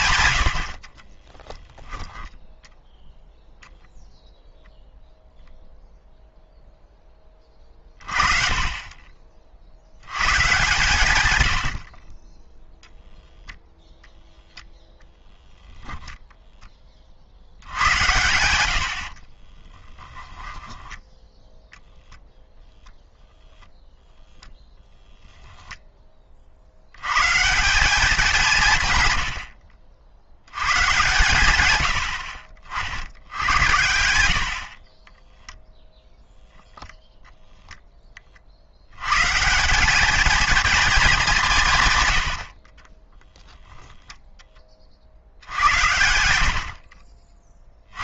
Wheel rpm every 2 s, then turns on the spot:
90, 10, 0, 0, 30, 130, 0, 0, 10, 80, 10, 0, 10, 60, 160, 110, 60, 50, 0, 60, 220, 40, 10, 80.
2-4 20-22 42-44